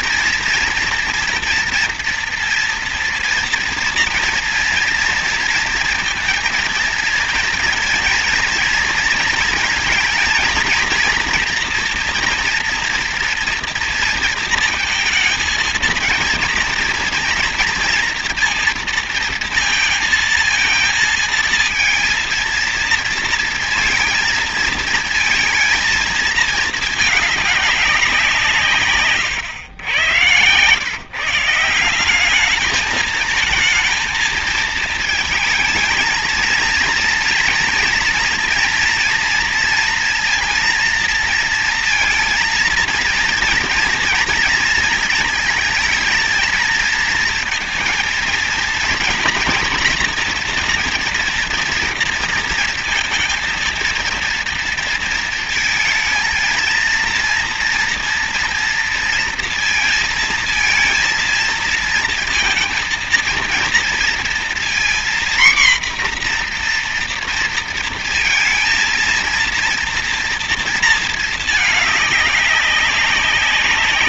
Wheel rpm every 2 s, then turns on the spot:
230, 230, 230, 230, 230, 220, 230, 230, 230, 230, 230, 230, 230, 220, 130, 140, 210, 220, 230, 230, 230, 230, 230, 230, 230, 230, 230, 230, 230, 230, 230, 230, 240, 240, 230, 230, 200.
none